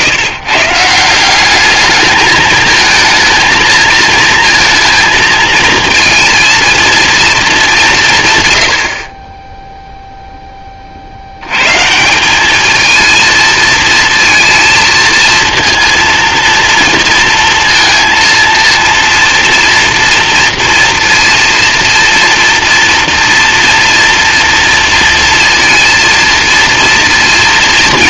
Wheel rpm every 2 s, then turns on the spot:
160, 220, 230, 230, 90, 20, 210, 230, 240, 230, 230, 230, 230, 230.
none